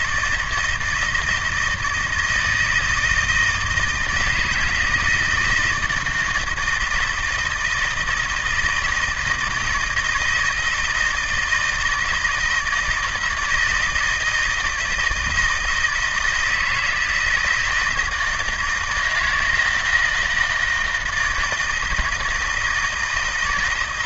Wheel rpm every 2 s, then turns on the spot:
160, 160, 170, 160, 160, 160, 160, 160, 160, 160, 160, 160.
none